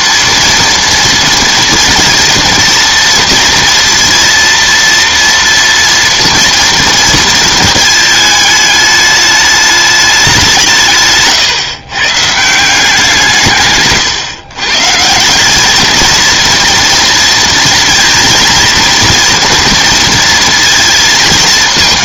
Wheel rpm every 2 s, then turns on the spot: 230, 230, 230, 230, 210, 150, 170, 140, 230, 230, 230.
none